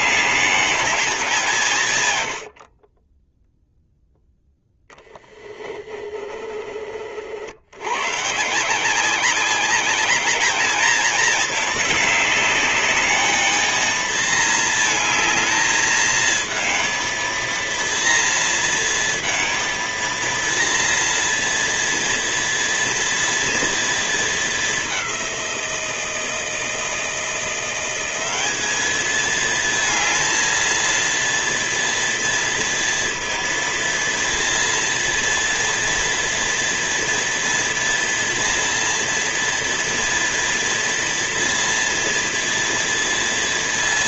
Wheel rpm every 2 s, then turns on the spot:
210, 60, 10, 40, 170, 210, 210, 220, 220, 230, 230, 230, 200, 160, 210, 230, 230, 230, 240, 240, 230, 230.
none